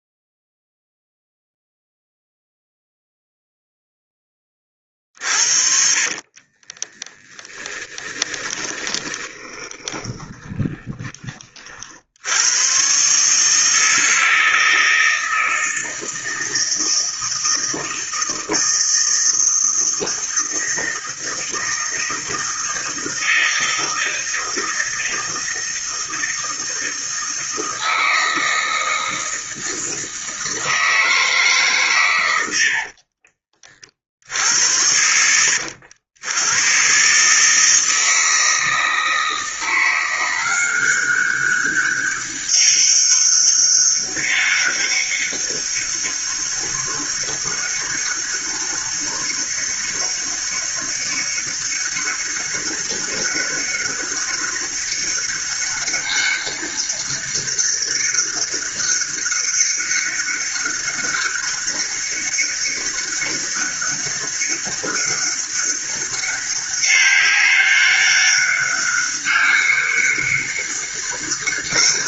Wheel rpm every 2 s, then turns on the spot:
0, 0, 10, 40, 20, 20, 90, 160, 160, 160, 160, 160, 160, 160, 160, 160, 100, 70, 100, 160, 180, 200, 200, 200, 200, 200, 200, 200, 200, 200, 200, 200, 200, 200, 200, 200.
6-12